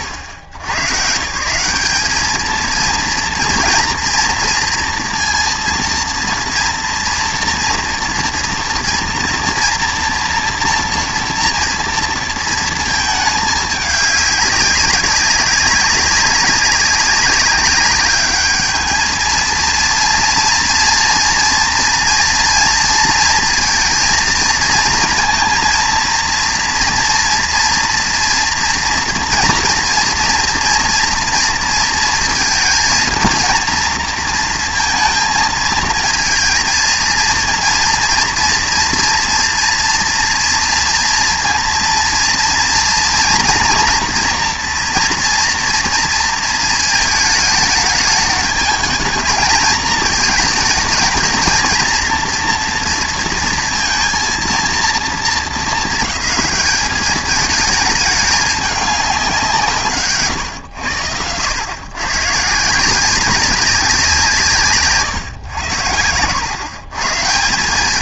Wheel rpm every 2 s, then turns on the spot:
90, 230, 230, 240, 230, 230, 220, 200, 200, 210, 230, 230, 230, 230, 230, 240, 220, 230, 230, 230, 230, 230, 240, 220, 210, 220, 240, 230, 210, 200, 110, 160, 150, 120.
none